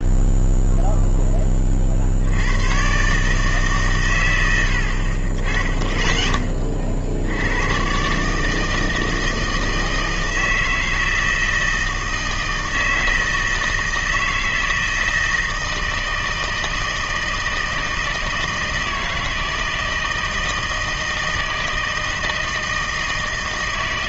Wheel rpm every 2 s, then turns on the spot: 0, 110, 80, 40, 160, 160, 160, 160, 160, 160, 160, 160.
none